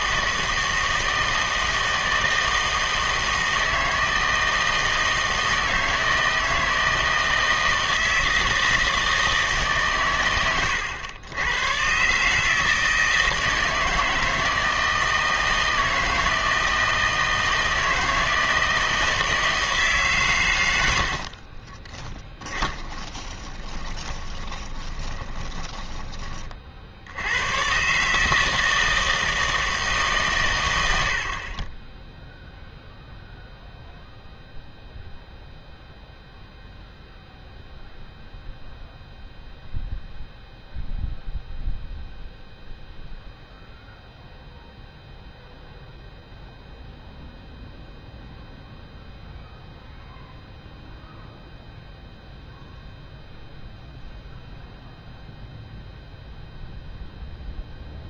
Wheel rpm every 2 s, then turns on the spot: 160, 160, 160, 160, 160, 110, 150, 160, 160, 160, 110, 10, 20, 40, 160, 110, 0, 0, 0, 0, 0, 0, 0, 0, 0, 0, 0, 0, 0.
22-26